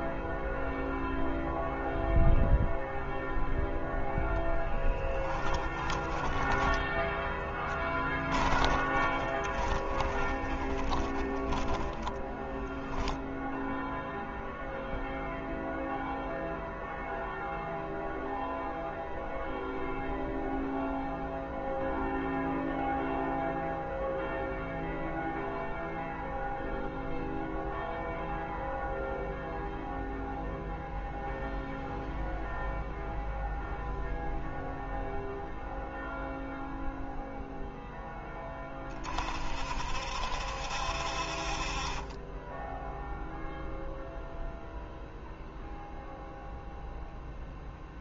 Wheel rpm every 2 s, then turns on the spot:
0, 0, 10, 10, 20, 20, 10, 0, 0, 0, 0, 0, 0, 0, 0, 0, 0, 0, 0, 30, 60, 10, 0, 0.
6-12